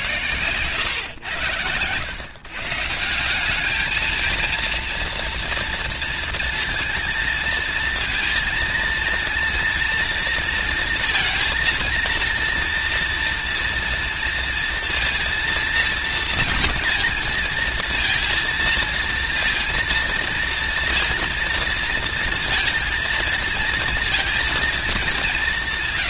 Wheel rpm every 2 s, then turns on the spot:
140, 140, 230, 230, 230, 230, 230, 230, 230, 230, 230, 230, 230.
none